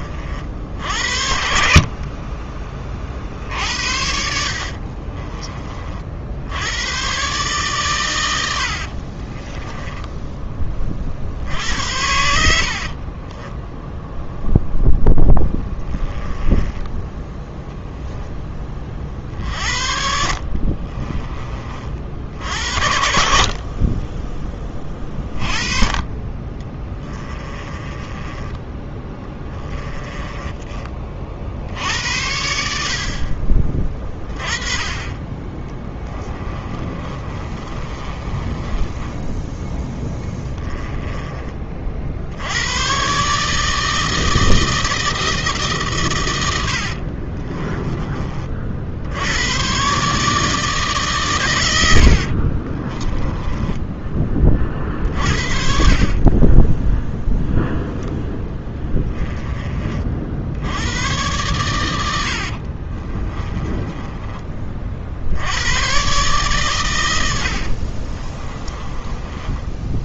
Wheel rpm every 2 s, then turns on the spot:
70, 40, 50, 110, 60, 30, 50, 0, 10, 30, 40, 50, 20, 20, 10, 20, 60, 40, 30, 20, 10, 120, 160, 60, 60, 150, 30, 50, 10, 10, 100, 40, 50, 120, 20.
4-6 8-10 12-14 20-22 26-30 34-42 46-48 52-60 62-64 68-70